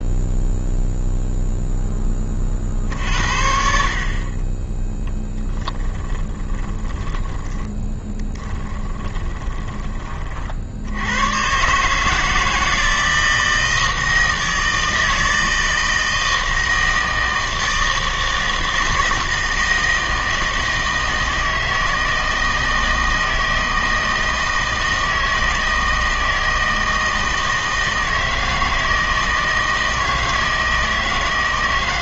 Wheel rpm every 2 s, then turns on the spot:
0, 50, 10, 10, 10, 60, 160, 160, 160, 160, 160, 160, 160, 160, 160, 160.
6-10